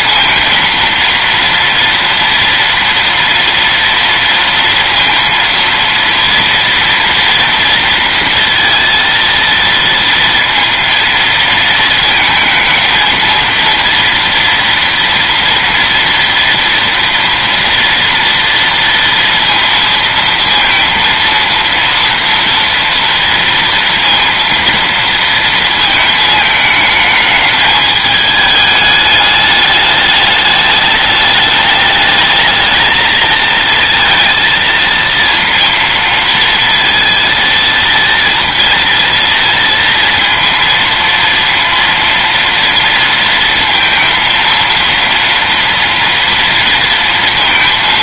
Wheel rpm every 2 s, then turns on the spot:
230, 230, 230, 230, 230, 230, 220, 230, 230, 230, 230, 230, 230, 220, 210, 210, 220, 230, 230, 230, 230, 230, 230, 230.
none